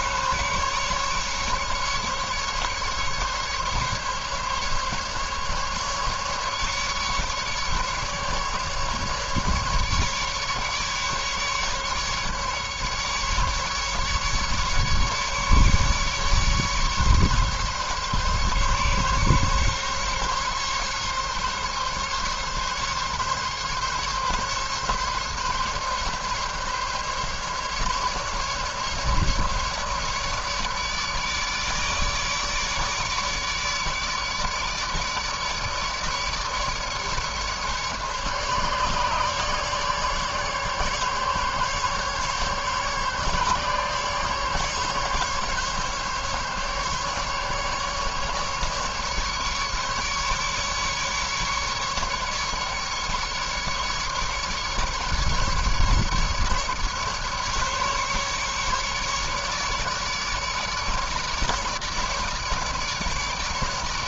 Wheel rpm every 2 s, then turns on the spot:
140, 140, 140, 140, 150, 150, 150, 140, 140, 140, 140, 140, 140, 140, 140, 150, 150, 150, 150, 140, 140, 140, 140, 140, 150, 150, 150, 150, 140, 150, 150, 150.
none